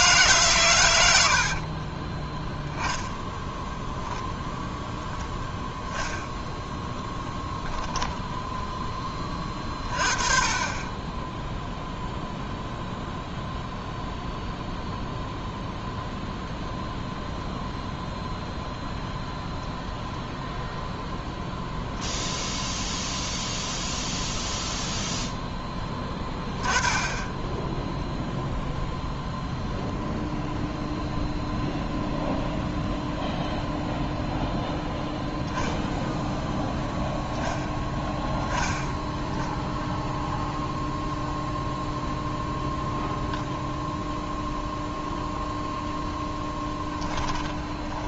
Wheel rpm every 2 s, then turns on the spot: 120, 10, 0, 10, 10, 20, 0, 0, 0, 0, 0, 0, 0, 10, 0, 0, 0, 0, 0, 10, 0, 0, 0, 10.
46-48